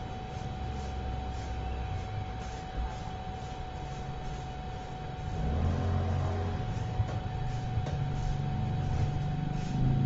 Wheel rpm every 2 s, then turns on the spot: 0, 0, 0, 0, 0.
none